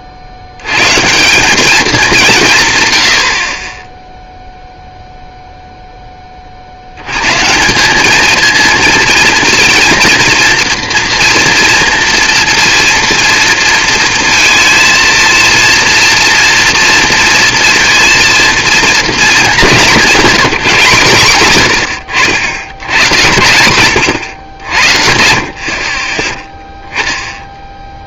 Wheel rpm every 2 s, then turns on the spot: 80, 200, 0, 50, 220, 230, 230, 230, 230, 230, 160, 100, 100, 10.
none